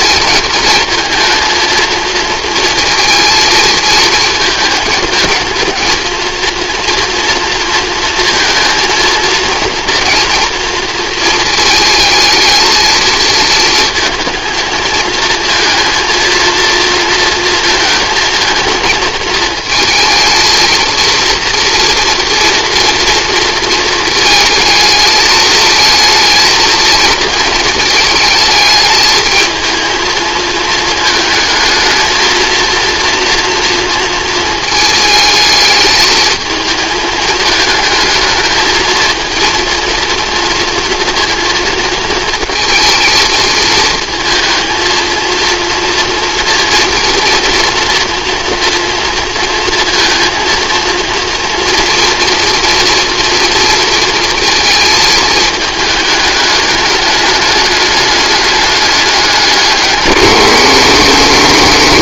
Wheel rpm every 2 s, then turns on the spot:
220, 230, 220, 230, 230, 230, 220, 230, 230, 230, 220, 230, 220, 230, 220, 220, 230, 220, 220, 220, 230, 220, 230, 230, 230, 230, 240, 230, 210, 200, 120.
none